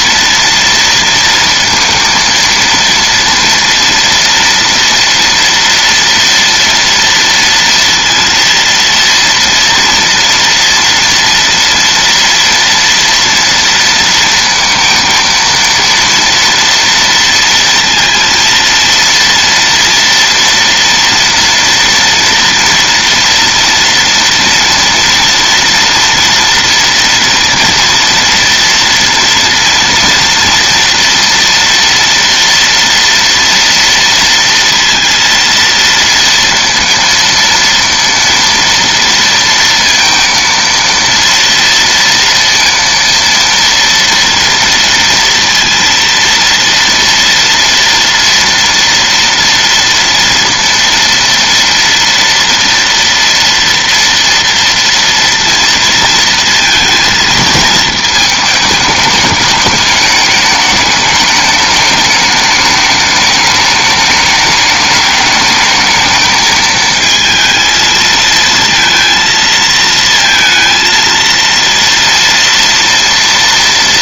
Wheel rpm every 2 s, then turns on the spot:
230, 230, 230, 230, 230, 230, 230, 230, 230, 230, 230, 230, 230, 240, 230, 240, 230, 230, 230, 230, 230, 230, 230, 230, 240, 230, 230, 230, 230, 210, 210, 210, 210, 220, 230, 230, 230.
none